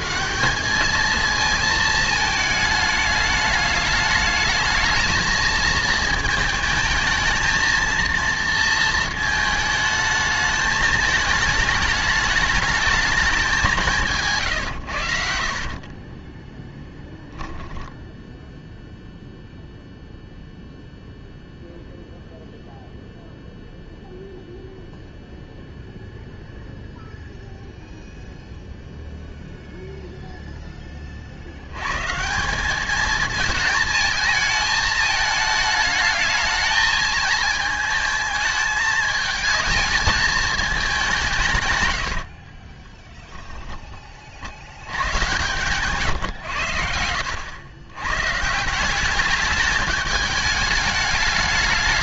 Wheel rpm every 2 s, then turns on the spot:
200, 220, 220, 220, 230, 210, 210, 120, 10, 0, 0, 0, 0, 0, 0, 10, 200, 220, 220, 220, 220, 40, 80, 90, 170, 210.
14-18 42-44